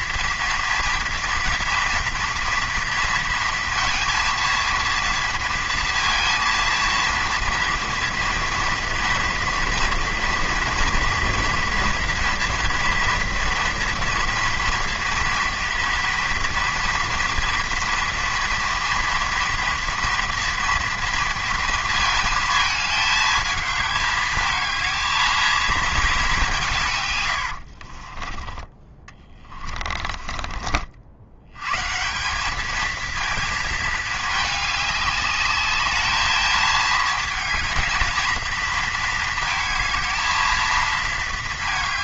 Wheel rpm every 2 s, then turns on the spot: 230, 230, 230, 230, 230, 230, 230, 230, 230, 230, 230, 220, 220, 150, 20, 60, 220, 210, 220, 230, 220.
none